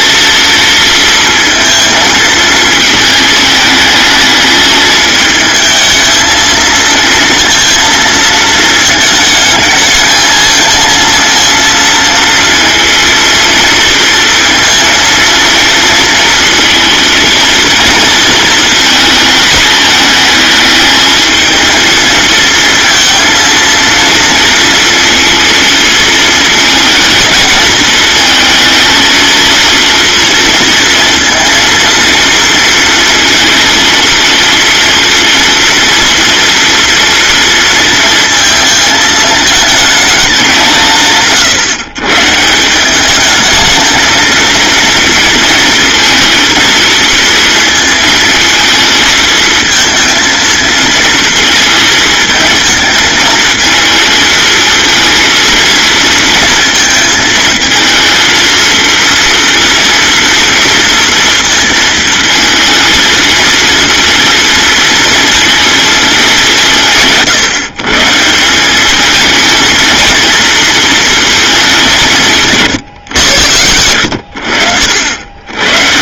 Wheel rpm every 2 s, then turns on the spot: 230, 220, 220, 230, 220, 230, 230, 230, 230, 220, 220, 230, 230, 220, 230, 230, 230, 230, 230, 220, 150, 220, 230, 230, 220, 220, 220, 230, 220, 230, 230, 230, 230, 150, 220, 220, 90, 70.
none